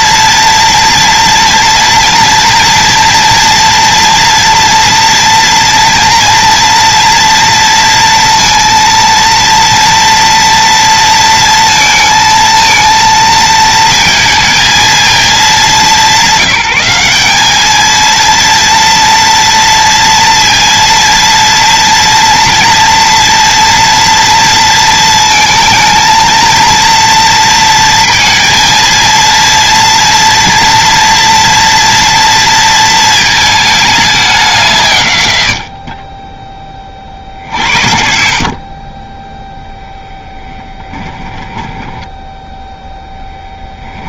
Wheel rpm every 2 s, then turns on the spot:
230, 230, 230, 230, 230, 230, 230, 220, 190, 230, 230, 230, 230, 230, 230, 230, 230, 150, 30, 30, 10, 0.
38-42